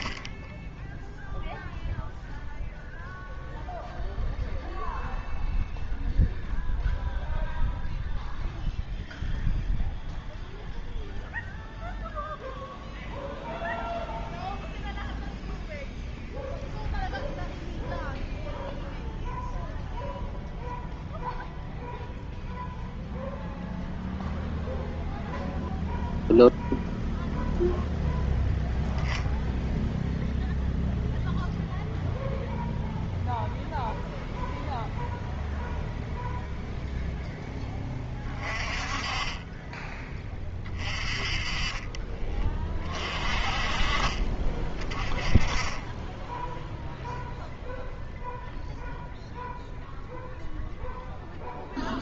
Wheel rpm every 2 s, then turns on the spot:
20, 0, 0, 0, 0, 0, 0, 0, 0, 0, 0, 0, 0, 0, 0, 0, 0, 0, 0, 20, 20, 30, 30, 0, 0, 0.
none